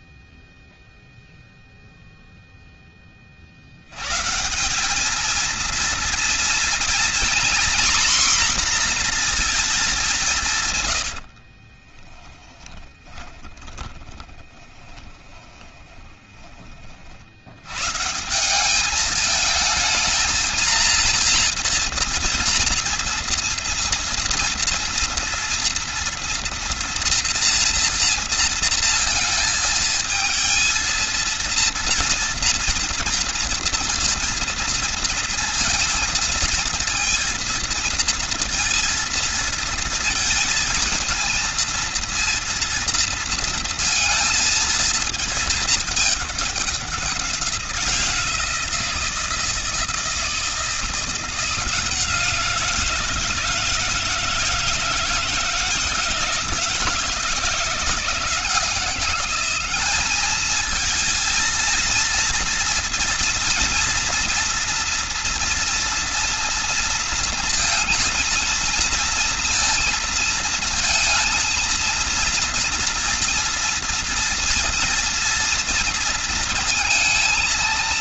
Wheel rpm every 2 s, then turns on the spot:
0, 40, 220, 230, 230, 60, 30, 30, 120, 220, 230, 230, 230, 230, 220, 230, 230, 230, 230, 230, 230, 230, 210, 180, 160, 170, 160, 160, 170, 200, 230, 230, 230, 230, 230, 230, 230, 230, 230.
10-16